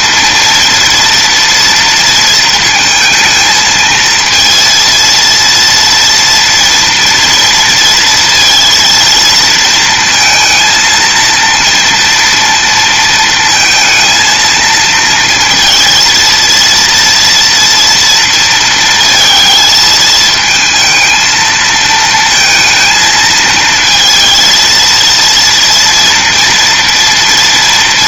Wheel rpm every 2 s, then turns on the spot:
230, 220, 230, 230, 230, 230, 230, 230, 230, 230, 220, 220, 230, 230.
none